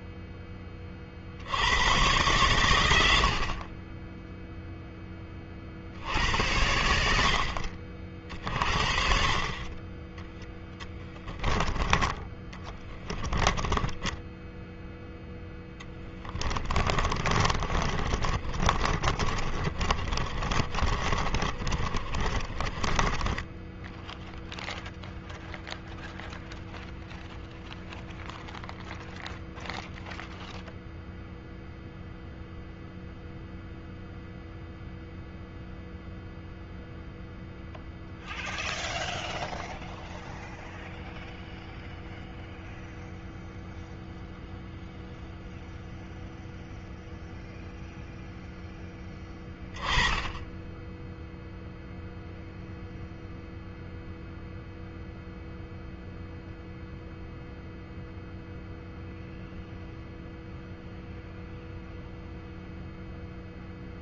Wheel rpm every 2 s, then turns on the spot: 30, 90, 10, 70, 50, 10, 20, 0, 30, 50, 30, 20, 0, 0, 0, 0, 0, 0, 0, 0, 0, 0, 0, 0, 10, 0, 0, 0, 0, 0, 0, 0.
12-14 16-24